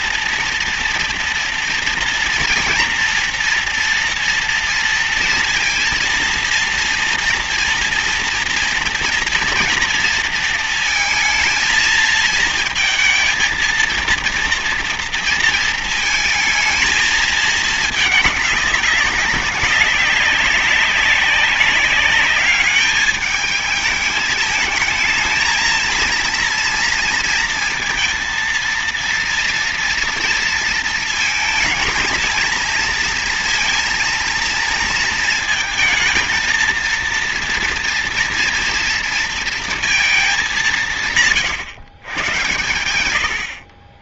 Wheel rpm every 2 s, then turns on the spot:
230, 240, 230, 230, 230, 230, 220, 230, 220, 210, 200, 200, 220, 230, 230, 230, 230, 230, 220, 230, 200, 120.
none